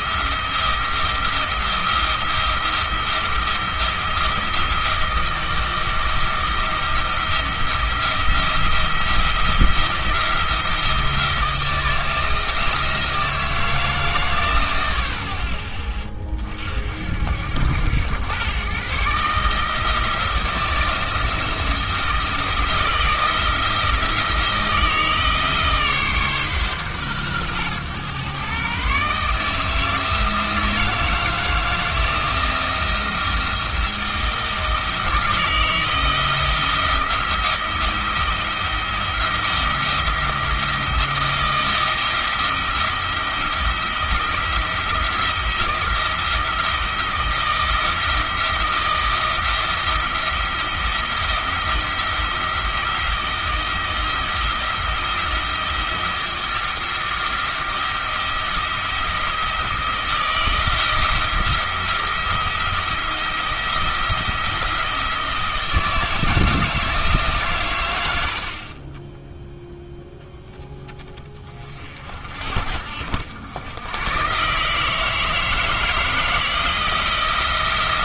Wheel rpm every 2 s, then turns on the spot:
170, 170, 170, 170, 170, 170, 160, 110, 60, 130, 170, 170, 160, 130, 140, 160, 170, 170, 170, 170, 160, 170, 170, 170, 160, 170, 170, 170, 170, 170, 170, 170, 170, 160, 30, 10, 70, 150, 170.
none